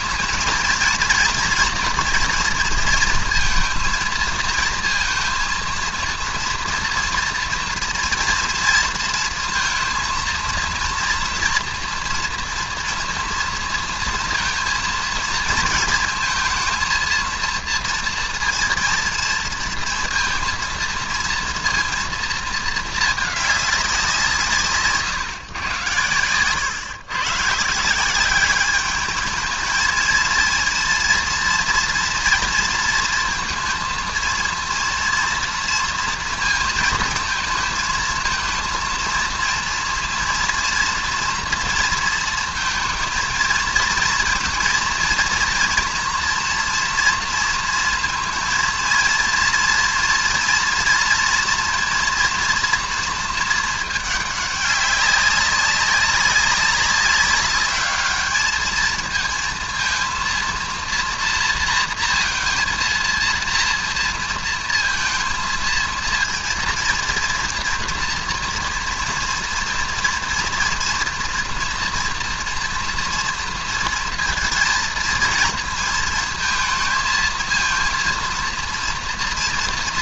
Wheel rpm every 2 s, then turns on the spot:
230, 230, 230, 230, 230, 230, 230, 230, 230, 230, 230, 220, 150, 120, 200, 230, 230, 230, 230, 230, 230, 230, 230, 230, 230, 230, 230, 200, 190, 220, 230, 230, 230, 230, 230, 230, 230, 230, 230, 230.
none